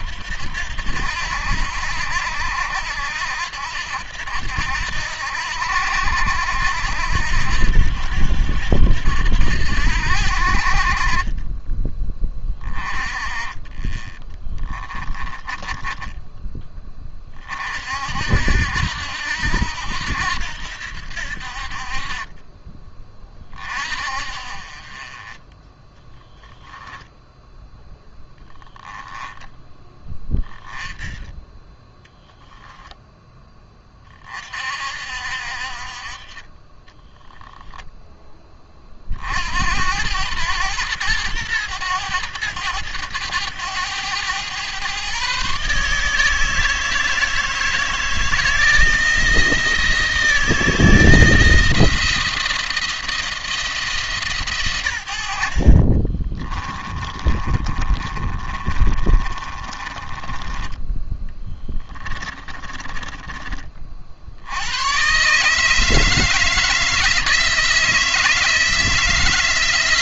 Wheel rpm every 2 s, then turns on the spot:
80, 80, 80, 80, 80, 50, 20, 20, 20, 70, 80, 30, 30, 10, 10, 20, 10, 40, 20, 30, 110, 100, 110, 160, 160, 160, 170, 110, 30, 30, 20, 20, 80, 160, 160.
14-16 36-38 56-60 62-64